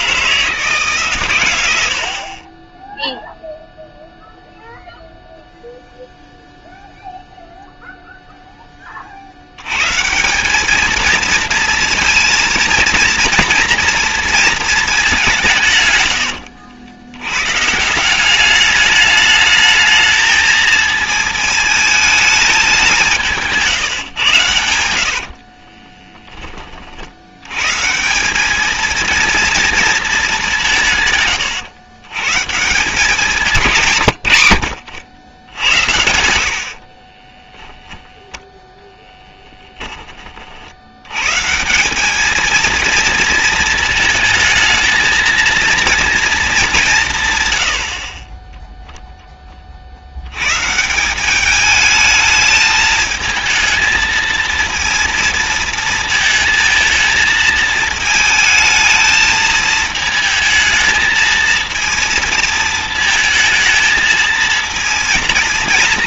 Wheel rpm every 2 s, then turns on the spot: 150, 20, 0, 0, 20, 210, 230, 220, 90, 210, 220, 200, 110, 30, 210, 170, 160, 90, 60, 10, 70, 220, 220, 190, 0, 130, 220, 230, 220, 220, 220, 230, 230.
36-38